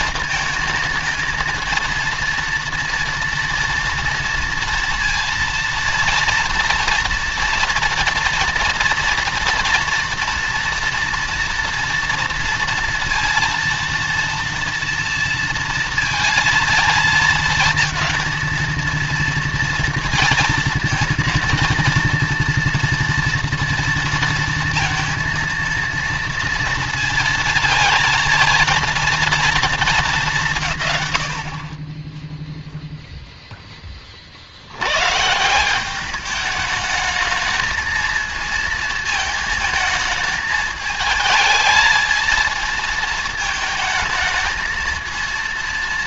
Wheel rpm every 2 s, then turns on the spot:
220, 230, 230, 230, 230, 230, 230, 230, 230, 230, 230, 230, 230, 230, 230, 120, 0, 100, 210, 220, 220, 220, 220.
none